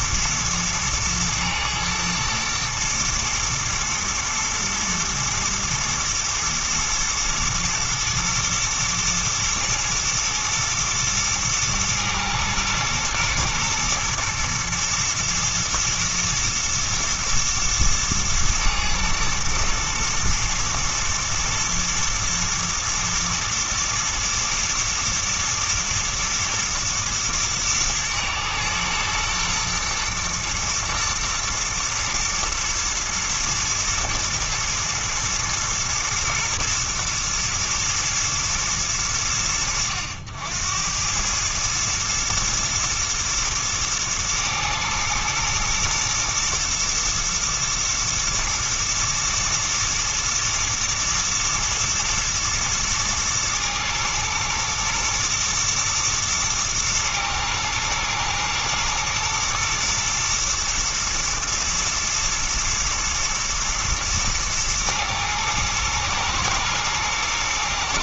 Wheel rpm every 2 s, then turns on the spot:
110, 120, 120, 120, 110, 120, 110, 120, 110, 110, 120, 110, 120, 120, 110, 110, 120, 110, 120, 90, 90, 110, 120, 120, 120, 110, 110, 110, 110, 110, 120, 110, 110, 110.
none